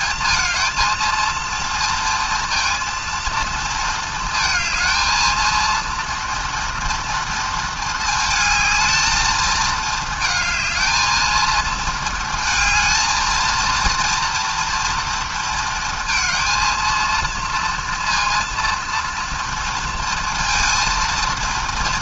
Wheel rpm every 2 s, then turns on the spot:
220, 230, 230, 230, 220, 220, 230, 230, 230, 230, 220.
none